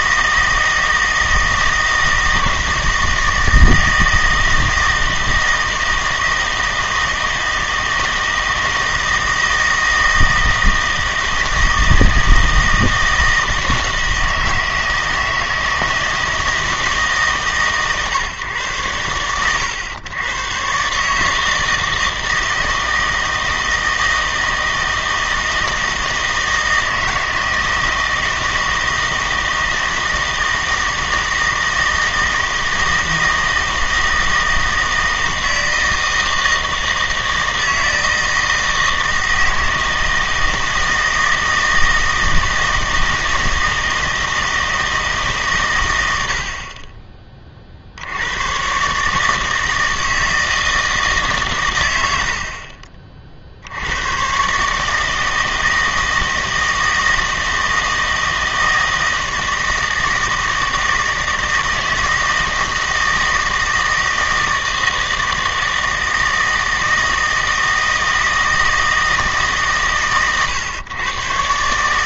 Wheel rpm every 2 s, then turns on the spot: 160, 160, 160, 160, 160, 160, 160, 160, 160, 110, 130, 160, 160, 160, 160, 160, 160, 160, 160, 160, 160, 160, 160, 40, 120, 160, 50, 150, 160, 160, 160, 160, 160, 160, 160, 120.
none